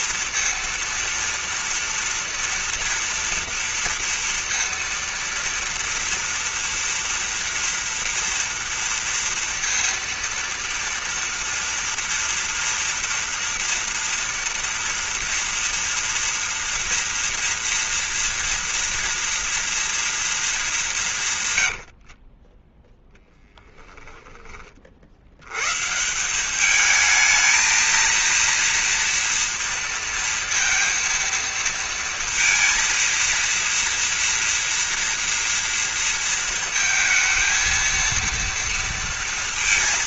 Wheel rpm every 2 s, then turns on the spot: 230, 230, 230, 240, 230, 230, 230, 230, 230, 230, 200, 20, 50, 210, 230, 230, 230, 230, 230, 230.
none